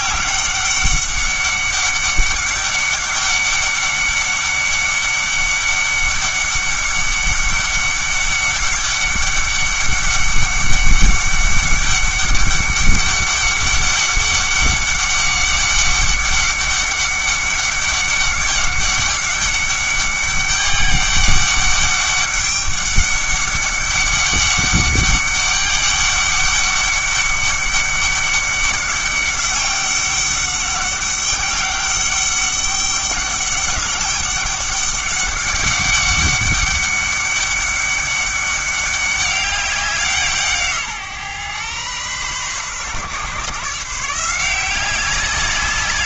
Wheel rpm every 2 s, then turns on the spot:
200, 200, 200, 200, 200, 200, 200, 200, 200, 200, 200, 200, 200, 200, 200, 200, 200, 200, 200, 200, 150, 130, 180.
none